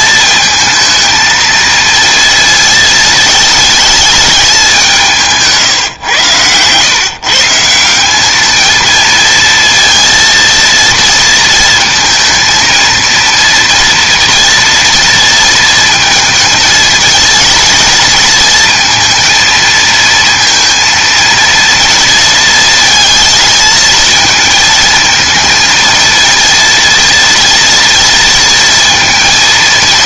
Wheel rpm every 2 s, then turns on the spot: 230, 230, 180, 120, 220, 230, 230, 230, 220, 230, 230, 220, 220, 230, 220.
none